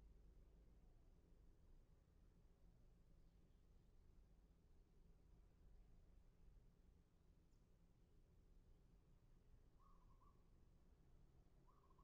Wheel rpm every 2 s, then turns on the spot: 0, 0, 0, 0, 0, 0.
none